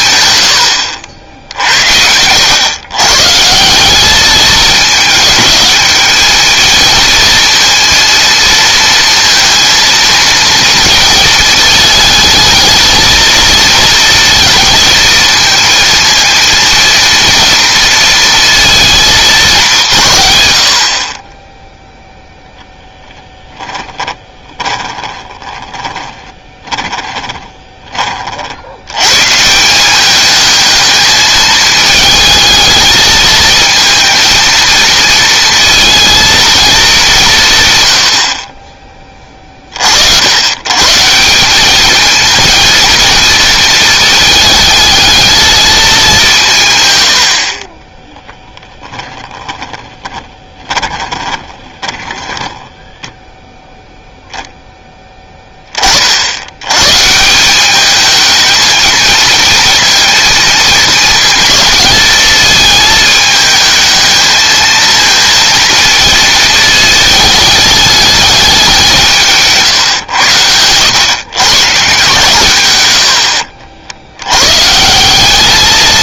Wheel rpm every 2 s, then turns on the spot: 80, 120, 210, 220, 230, 220, 220, 230, 230, 220, 50, 10, 20, 20, 90, 220, 220, 230, 210, 30, 140, 230, 220, 130, 10, 20, 10, 0, 120, 220, 220, 220, 220, 220, 180, 100, 100, 160.
22-28 50-54